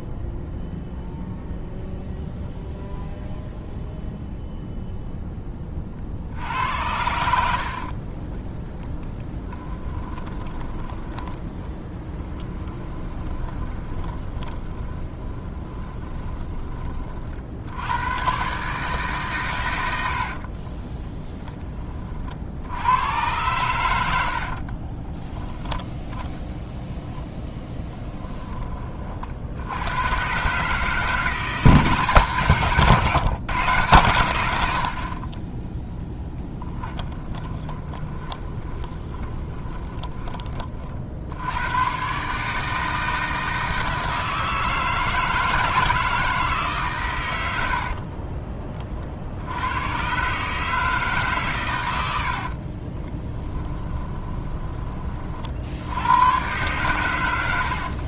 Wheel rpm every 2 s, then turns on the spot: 0, 0, 0, 80, 10, 10, 20, 20, 20, 140, 20, 80, 40, 10, 30, 150, 150, 70, 10, 20, 40, 160, 160, 140, 30, 150, 40, 20, 110.
12-16 20-22 24-26 36-40 52-54